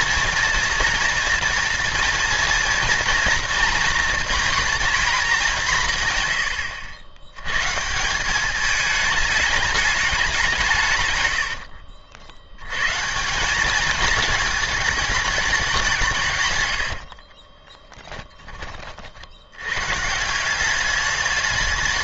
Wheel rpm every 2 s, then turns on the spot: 230, 230, 240, 90, 200, 170, 110, 220, 100, 30, 180.
none